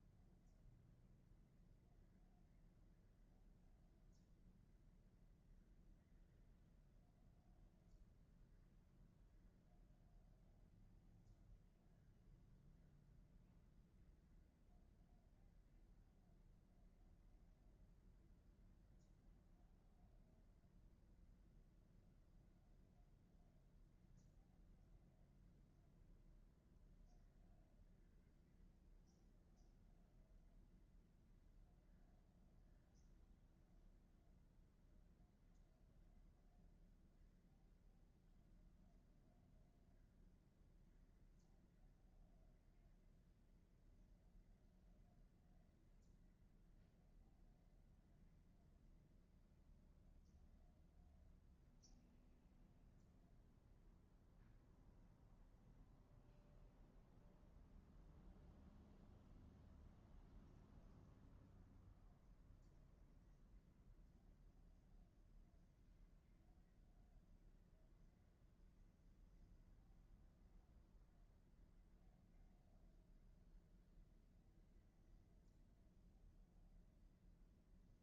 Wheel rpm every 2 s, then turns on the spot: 0, 0, 0, 0, 0, 0, 0, 0, 0, 0, 0, 0, 0, 0, 0, 0, 0, 0, 0, 0, 0, 0, 0, 0, 0, 0, 0, 0, 0, 0, 0, 0, 0, 0, 0, 0, 0, 0, 0.
none